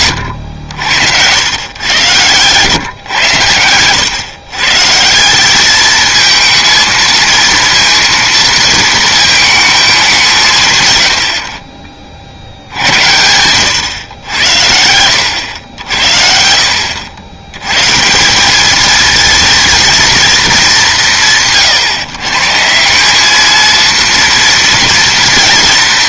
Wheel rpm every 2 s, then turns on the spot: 80, 120, 140, 230, 230, 140, 80, 80, 70, 210, 170, 150, 240.
none